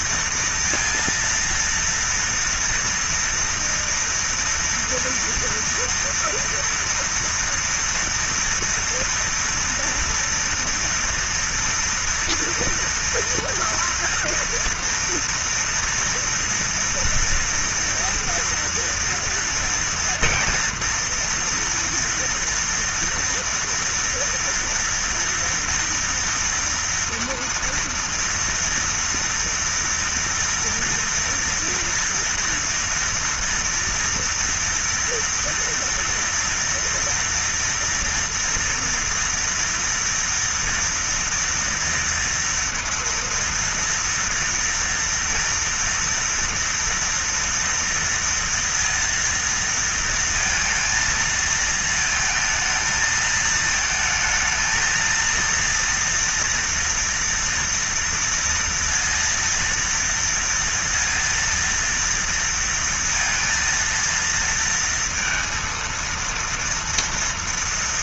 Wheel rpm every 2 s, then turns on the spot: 230, 230, 230, 230, 230, 230, 230, 230, 230, 230, 230, 230, 230, 230, 230, 230, 230, 230, 240, 240, 230, 230, 230, 230, 230, 230, 220, 230, 240, 230, 230, 230, 230, 230.
none